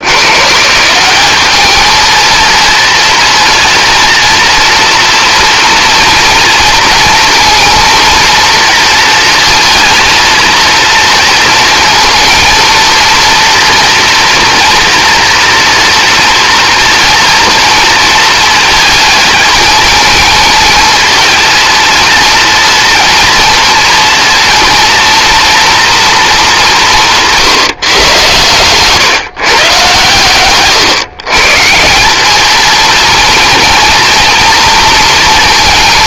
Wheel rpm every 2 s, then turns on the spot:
170, 230, 230, 230, 230, 230, 230, 240, 240, 230, 220, 230, 230, 190, 130, 140, 230, 230.
none